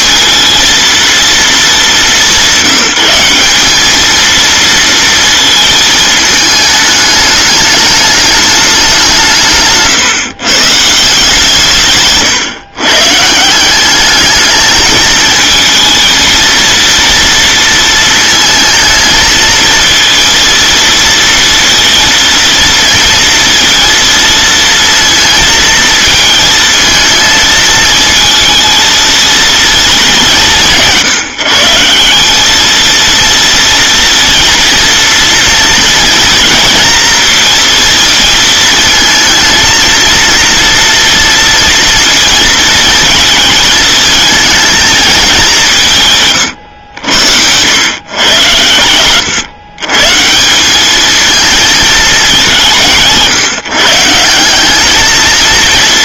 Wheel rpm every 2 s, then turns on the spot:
230, 190, 230, 210, 200, 150, 130, 210, 230, 220, 230, 230, 230, 220, 220, 160, 220, 230, 230, 230, 230, 220, 220, 100, 100, 180, 170, 190.
none